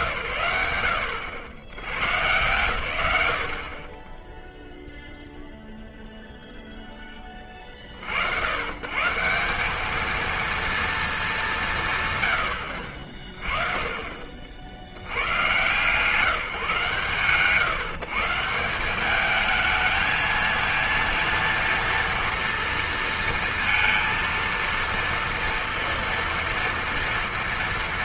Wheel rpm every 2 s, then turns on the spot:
110, 30, 0, 90, 230, 120, 50, 150, 150, 220, 230, 230, 230, 240.
none